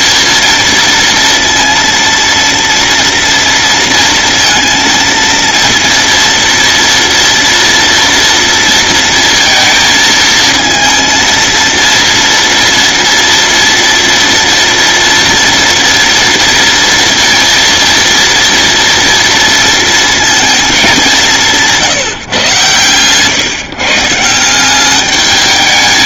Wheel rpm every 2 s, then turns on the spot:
230, 230, 230, 230, 230, 230, 230, 230, 230, 230, 200, 120, 190.
none